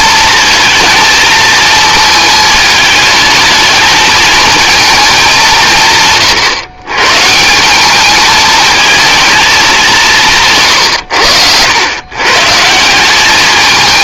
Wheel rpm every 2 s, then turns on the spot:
230, 220, 230, 110, 220, 140, 170.
none